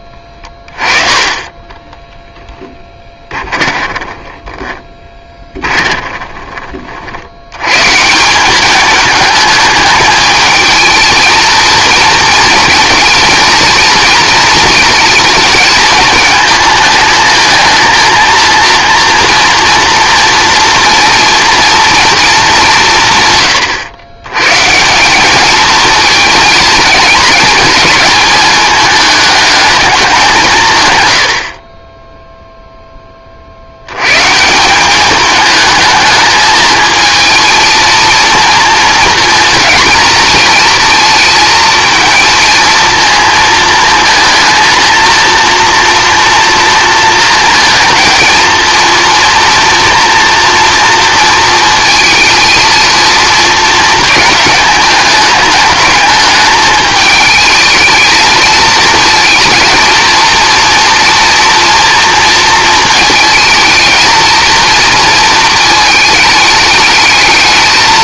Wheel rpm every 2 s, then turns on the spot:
30, 10, 10, 30, 200, 220, 220, 230, 220, 230, 230, 200, 150, 220, 210, 160, 0, 170, 220, 230, 220, 230, 230, 240, 230, 240, 230, 210, 210, 220, 230, 230, 230, 210.
0-6